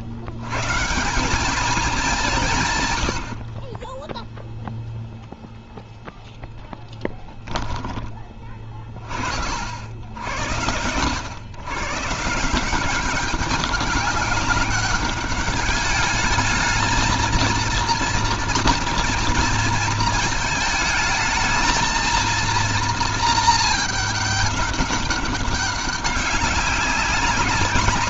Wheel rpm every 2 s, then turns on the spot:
140, 140, 0, 10, 20, 90, 180, 190, 220, 230, 220, 230, 200, 190.
6-8